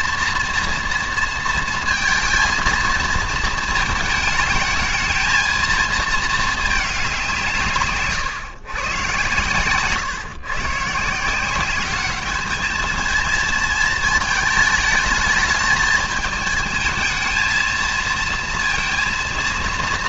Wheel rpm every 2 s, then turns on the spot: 230, 230, 220, 210, 130, 140, 220, 220, 220, 230.
none